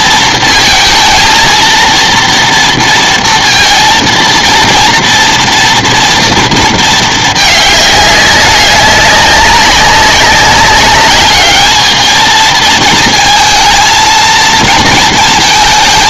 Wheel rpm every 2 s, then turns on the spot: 230, 230, 230, 230, 200, 200, 220, 220.
none